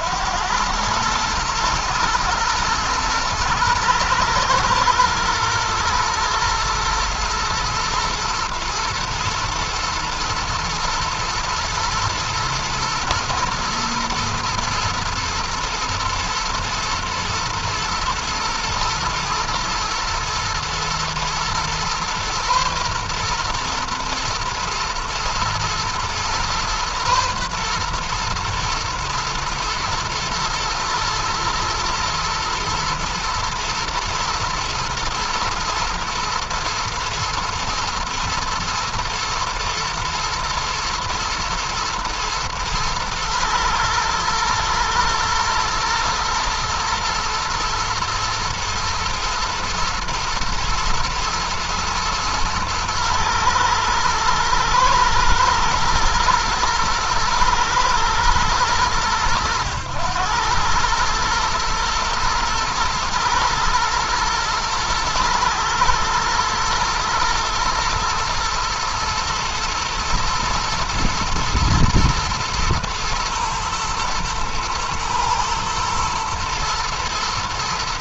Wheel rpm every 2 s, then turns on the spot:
110, 110, 120, 110, 120, 110, 120, 110, 110, 120, 120, 120, 120, 120, 120, 110, 110, 120, 110, 120, 110, 110, 110, 120, 120, 120, 120, 110, 120, 100, 110, 110, 110, 110, 120, 120, 110, 110, 110.
none